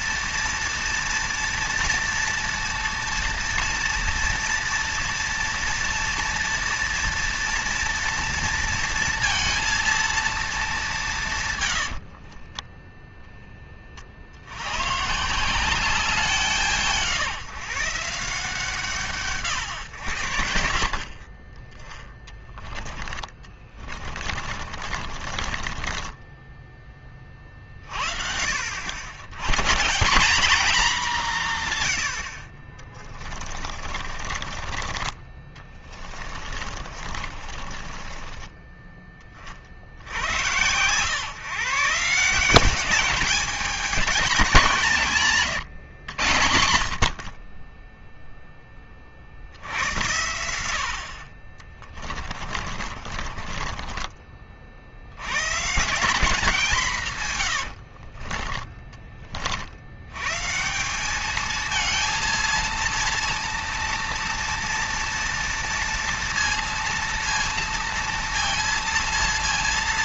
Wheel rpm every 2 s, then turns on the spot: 230, 230, 230, 230, 230, 200, 10, 110, 160, 160, 70, 20, 40, 20, 80, 210, 30, 30, 50, 20, 110, 190, 190, 60, 20, 60, 40, 60, 180, 30, 170, 230, 230, 230, 230.
22-26 32-34 36-38 52-54 58-60